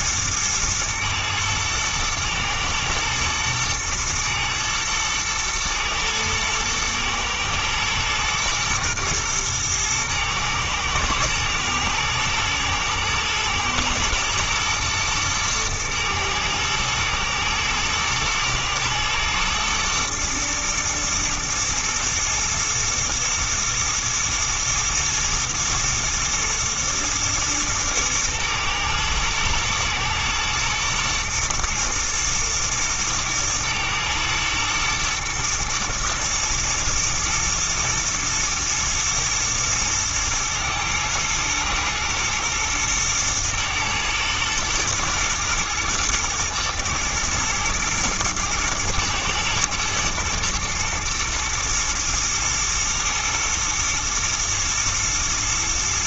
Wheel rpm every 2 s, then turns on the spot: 110, 110, 120, 110, 110, 110, 120, 110, 110, 120, 120, 120, 110, 120, 110, 120, 110, 120, 110, 110, 110, 110, 110, 110, 110, 120, 120, 120.
none